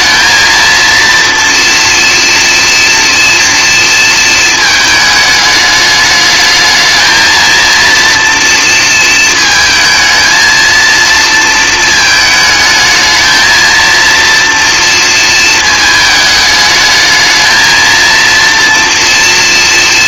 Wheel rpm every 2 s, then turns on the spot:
230, 230, 220, 220, 230, 230, 220, 230, 210, 230.
none